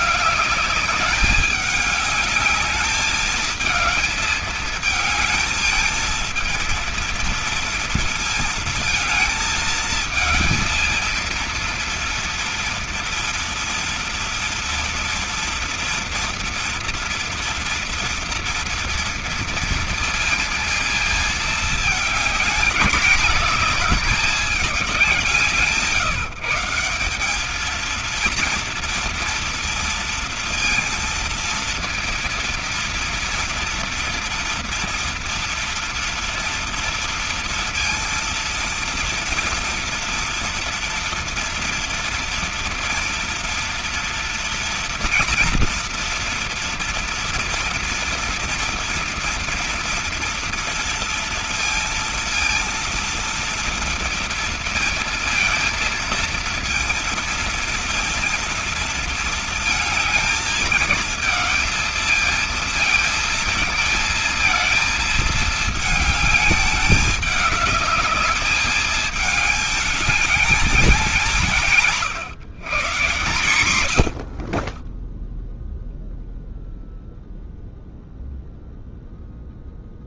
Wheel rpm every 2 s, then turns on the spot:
200, 210, 220, 220, 230, 220, 230, 230, 230, 230, 230, 220, 200, 170, 230, 230, 230, 230, 230, 230, 240, 230, 230, 240, 240, 230, 230, 230, 230, 230, 210, 220, 220, 210, 210, 200, 150, 30, 0, 0.
none